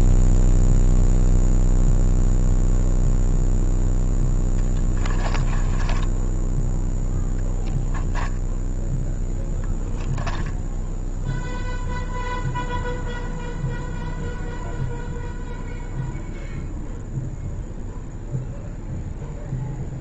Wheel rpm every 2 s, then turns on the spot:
0, 0, 10, 0, 0, 0, 0, 0, 0, 0.
4-6